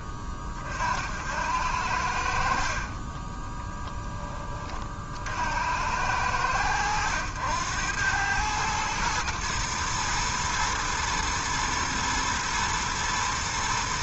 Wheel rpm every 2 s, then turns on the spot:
50, 50, 40, 90, 110, 110, 110.
2-4